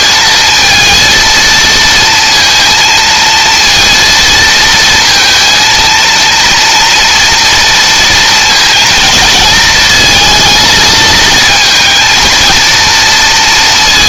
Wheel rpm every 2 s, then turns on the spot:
230, 230, 230, 240, 230, 220, 230.
none